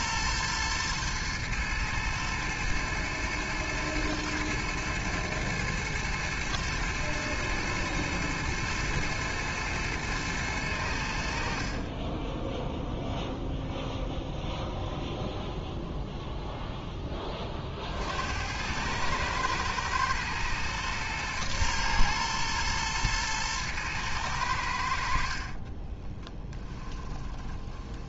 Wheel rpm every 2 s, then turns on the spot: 110, 110, 110, 120, 110, 80, 0, 0, 10, 100, 120, 110, 80, 10.
26-28